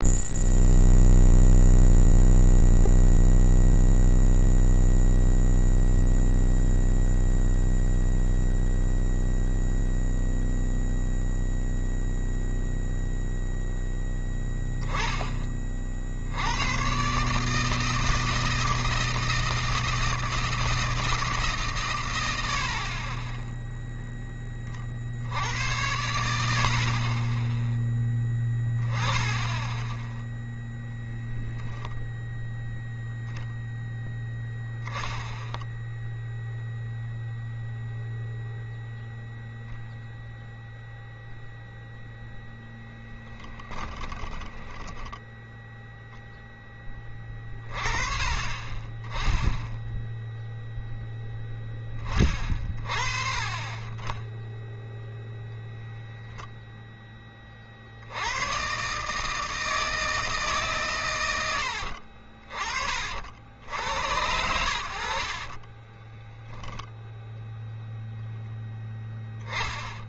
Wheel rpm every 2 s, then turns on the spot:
0, 0, 0, 0, 0, 0, 0, 0, 70, 160, 160, 80, 10, 70, 10, 0, 0, 0, 0, 0, 0, 0, 10, 0, 30, 0, 30, 10, 0, 90, 150, 50, 90, 10, 0.
44-46 66-68